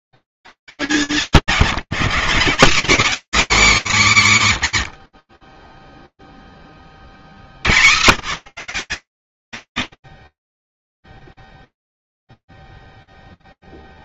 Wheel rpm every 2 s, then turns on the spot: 200, 190, 160, 40, 120, 0, 0.
none